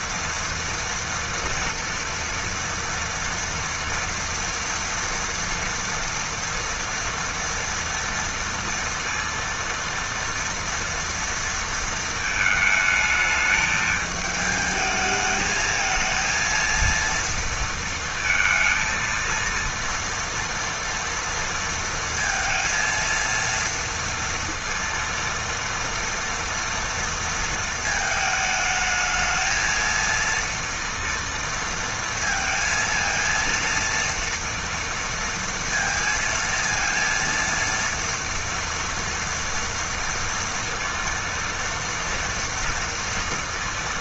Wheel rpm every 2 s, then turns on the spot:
230, 240, 230, 230, 230, 230, 220, 220, 230, 230, 230, 230, 230, 230, 220, 230, 230, 230, 230, 230, 230, 230.
none